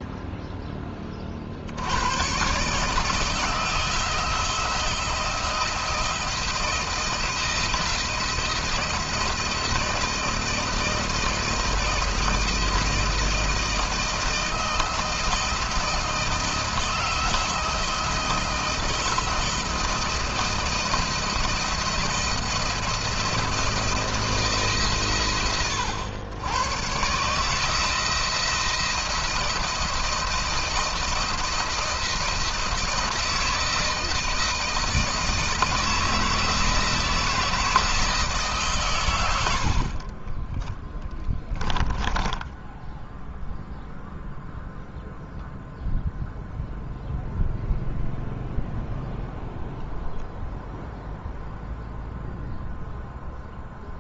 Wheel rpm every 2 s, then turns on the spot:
0, 120, 170, 170, 160, 160, 160, 160, 160, 170, 170, 170, 160, 100, 170, 160, 170, 160, 160, 150, 20, 10, 0, 0, 0, 0, 0.
40-44